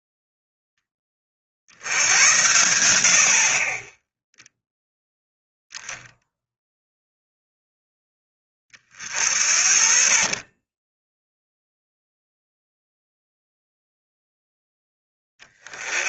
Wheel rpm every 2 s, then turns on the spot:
10, 90, 0, 0, 30, 20, 0, 10.
none